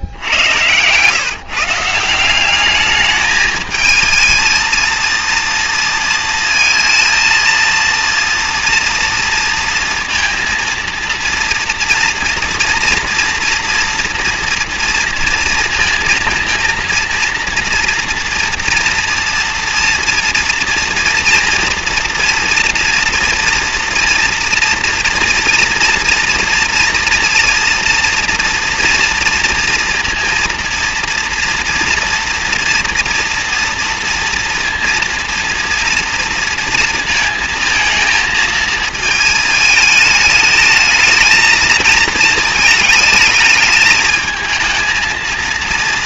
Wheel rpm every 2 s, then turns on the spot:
90, 180, 220, 230, 230, 230, 230, 230, 230, 230, 230, 230, 230, 230, 230, 230, 230, 230, 230, 220, 210, 230, 220.
0-2